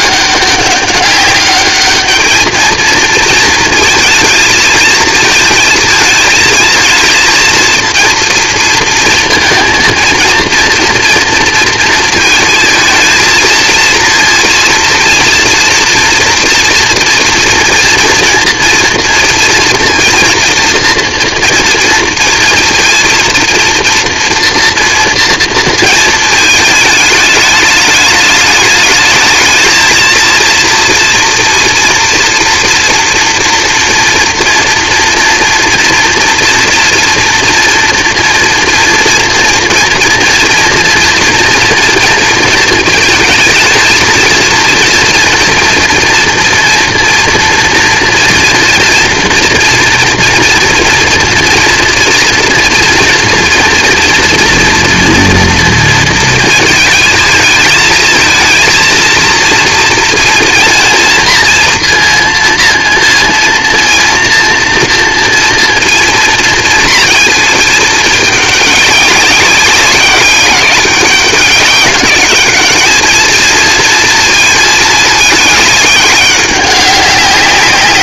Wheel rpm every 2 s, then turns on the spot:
200, 220, 230, 220, 230, 230, 230, 230, 230, 230, 230, 230, 230, 220, 210, 230, 240, 240, 240, 240, 240, 230, 230, 240, 230, 230, 230, 230, 230, 230, 230, 230, 240, 230, 210, 190, 210, 220, 200.
none